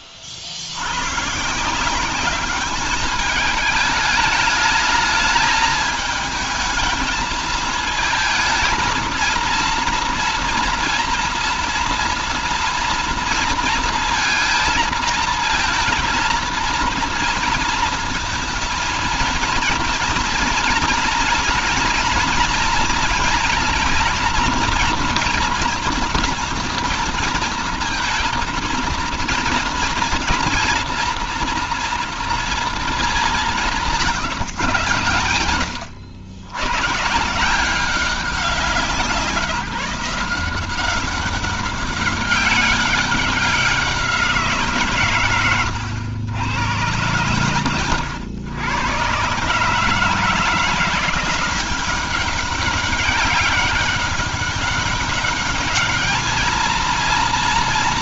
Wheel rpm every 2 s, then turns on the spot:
90, 210, 210, 220, 230, 230, 230, 230, 230, 220, 230, 230, 230, 230, 230, 230, 220, 120, 120, 180, 180, 190, 150, 120, 120, 170, 200, 200, 230.
none